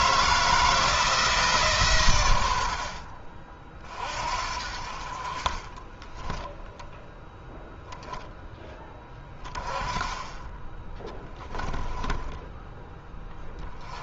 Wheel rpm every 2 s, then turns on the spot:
160, 80, 50, 10, 10, 20, 10.
none